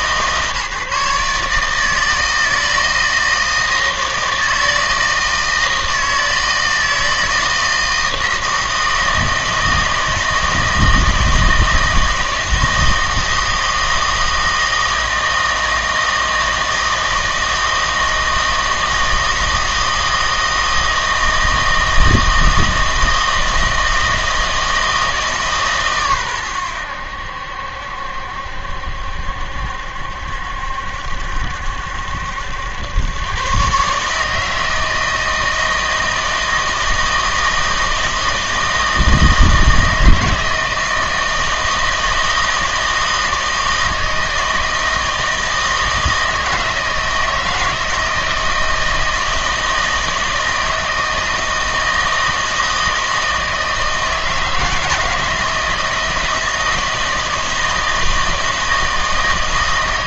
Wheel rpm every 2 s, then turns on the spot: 150, 160, 160, 160, 160, 160, 160, 160, 160, 160, 160, 160, 160, 100, 70, 70, 90, 160, 160, 160, 160, 160, 160, 160, 160, 160, 160, 160, 160, 160.
none